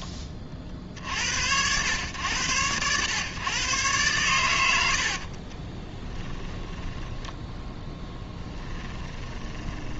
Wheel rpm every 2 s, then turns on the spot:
50, 110, 80, 10, 10.
4-10